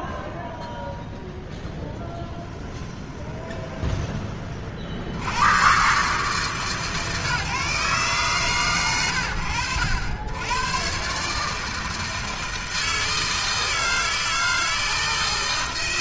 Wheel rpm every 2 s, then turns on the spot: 10, 20, 100, 130, 70, 150, 160, 160.
0-2